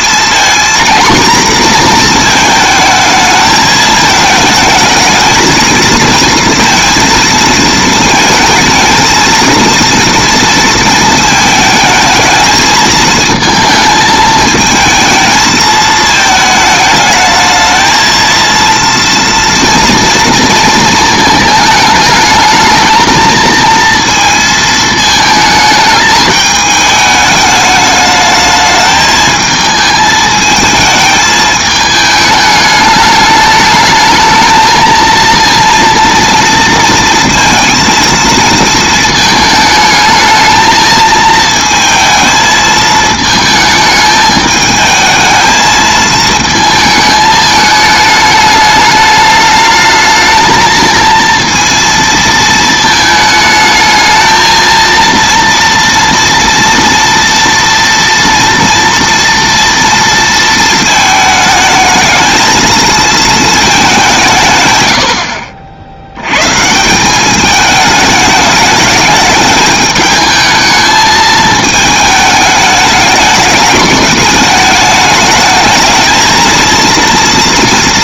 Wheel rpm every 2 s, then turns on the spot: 230, 220, 230, 230, 220, 230, 230, 220, 220, 230, 230, 220, 220, 210, 220, 220, 210, 220, 230, 220, 220, 220, 220, 220, 210, 220, 220, 230, 230, 230, 220, 220, 100, 160, 210, 220, 210, 210, 230.
none